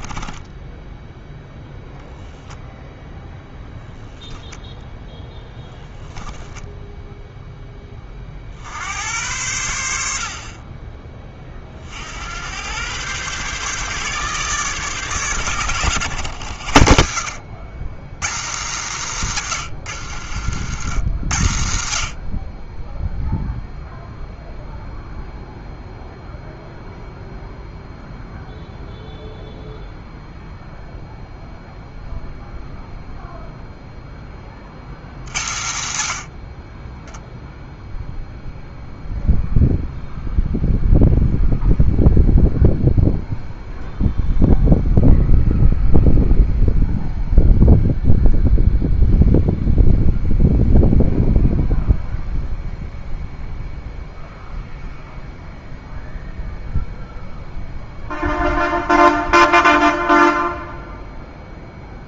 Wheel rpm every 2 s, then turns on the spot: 0, 0, 0, 0, 80, 20, 120, 140, 90, 160, 120, 0, 0, 0, 0, 0, 0, 80, 20, 0, 0, 0, 0, 0, 0, 0, 0, 0, 0, 0, 0.
none